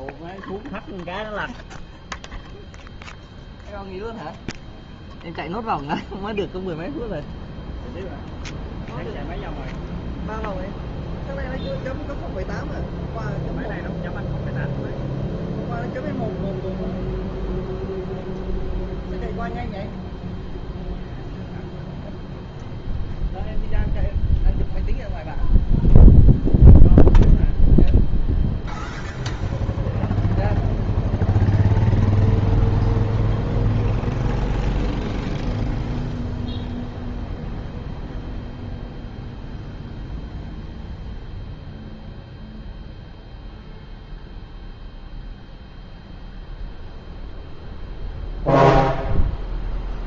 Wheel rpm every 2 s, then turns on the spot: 0, 0, 0, 0, 0, 0, 0, 0, 0, 0, 0, 0, 0, 0, 0, 0, 0, 0, 0, 0, 0, 0, 0, 0, 0.
none